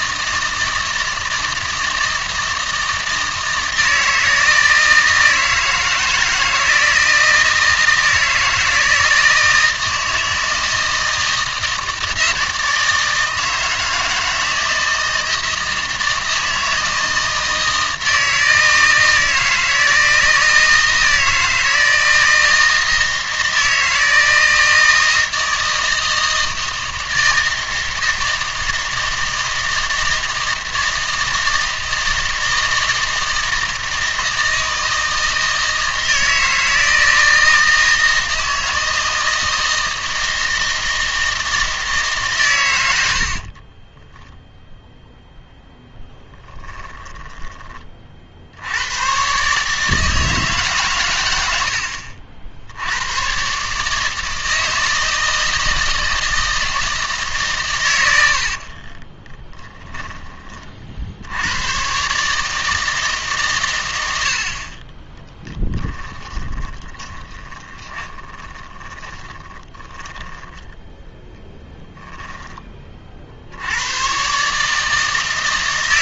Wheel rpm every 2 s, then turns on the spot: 160, 160, 160, 160, 160, 160, 160, 160, 160, 160, 160, 160, 160, 160, 160, 160, 160, 160, 160, 160, 160, 90, 0, 10, 80, 140, 80, 160, 160, 50, 50, 160, 30, 20, 20, 10, 30, 150.
46-48 58-60 66-72